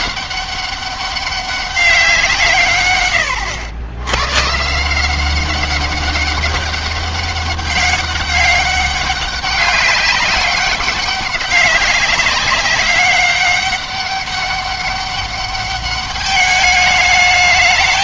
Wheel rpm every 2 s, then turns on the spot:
200, 140, 150, 200, 200, 200, 200, 200, 210.
none